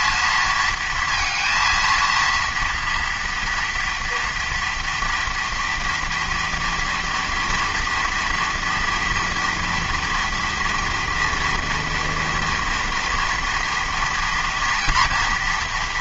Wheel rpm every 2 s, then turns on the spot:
220, 230, 240, 230, 230, 230, 230, 240.
none